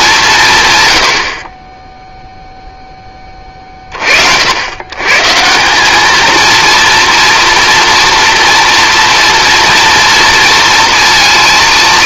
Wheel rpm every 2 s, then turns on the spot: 150, 0, 100, 230, 230, 230.
none